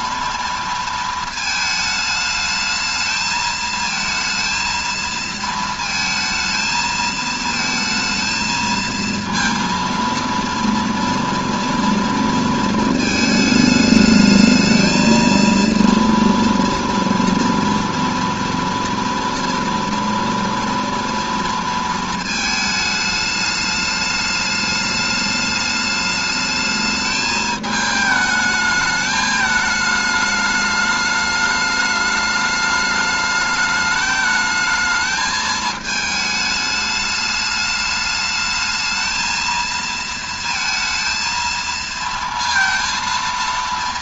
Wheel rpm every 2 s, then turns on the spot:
230, 220, 230, 220, 230, 230, 230, 220, 230, 230, 230, 220, 210, 210, 210, 210, 210, 220, 210, 220, 230, 230.
none